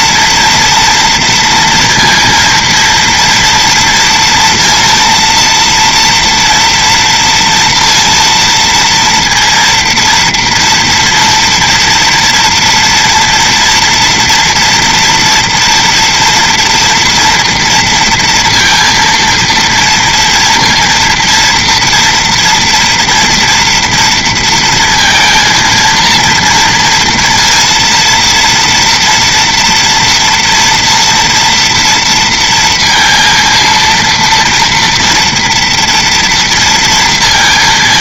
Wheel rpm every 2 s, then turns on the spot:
240, 230, 230, 230, 230, 230, 230, 230, 230, 230, 230, 230, 230, 230, 230, 230, 230, 230, 230.
none